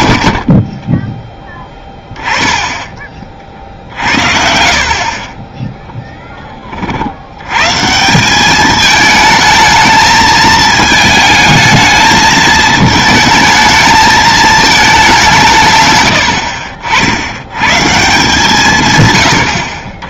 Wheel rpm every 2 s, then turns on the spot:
20, 20, 50, 40, 210, 220, 220, 210, 50, 140.
0-2 4-6